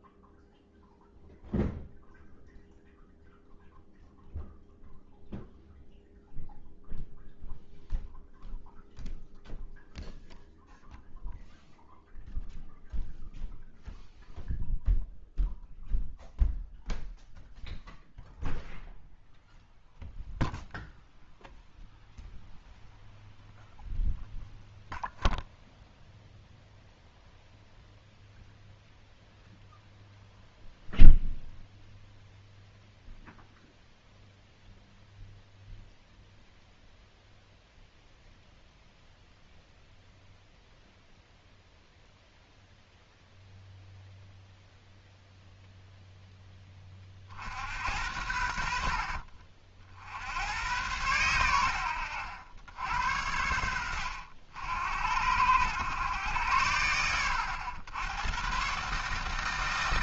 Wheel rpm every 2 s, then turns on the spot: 0, 0, 0, 0, 0, 0, 0, 0, 0, 0, 0, 0, 0, 0, 0, 0, 0, 0, 0, 0, 0, 0, 0, 20, 60, 100, 80, 70, 90, 130.
none